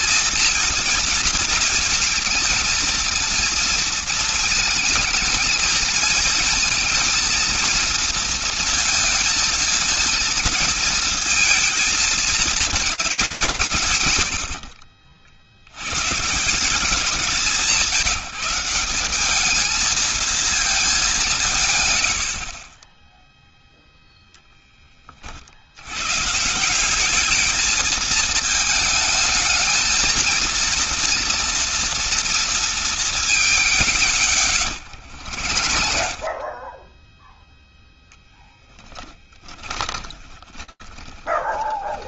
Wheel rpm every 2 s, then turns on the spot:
220, 230, 230, 220, 230, 230, 230, 100, 150, 170, 220, 80, 20, 180, 220, 230, 220, 80, 10, 20, 20.
34-36 38-42